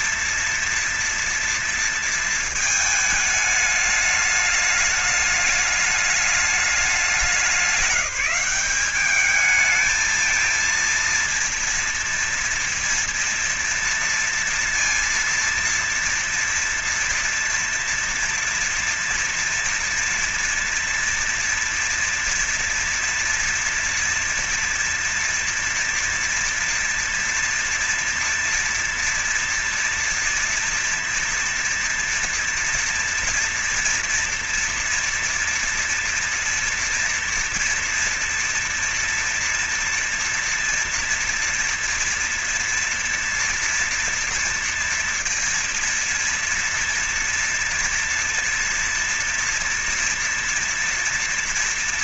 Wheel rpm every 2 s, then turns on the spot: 230, 220, 210, 210, 200, 230, 230, 230, 230, 230, 230, 230, 240, 230, 230, 230, 230, 230, 230, 230, 230, 230, 230, 230, 230, 240.
none